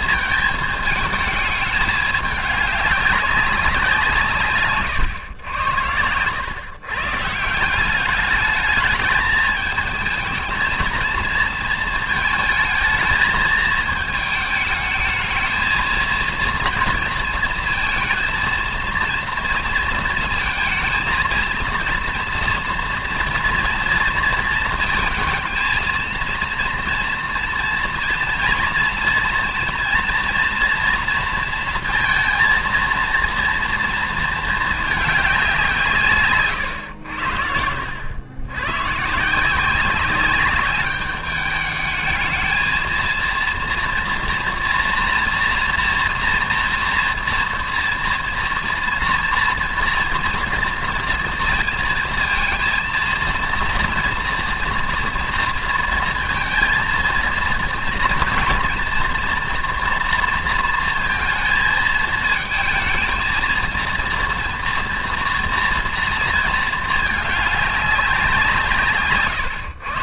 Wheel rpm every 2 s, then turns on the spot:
220, 200, 120, 140, 210, 230, 220, 220, 230, 230, 220, 230, 220, 230, 230, 230, 230, 210, 90, 130, 200, 230, 230, 230, 230, 240, 230, 230, 230, 230, 230, 220, 230, 220, 140.
none